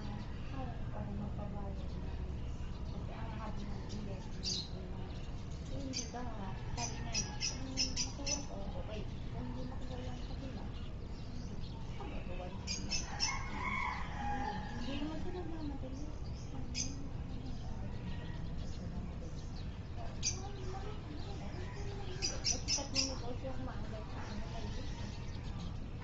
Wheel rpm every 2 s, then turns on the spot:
0, 0, 0, 0, 0, 0, 0, 0, 0, 0, 0, 0, 0.
none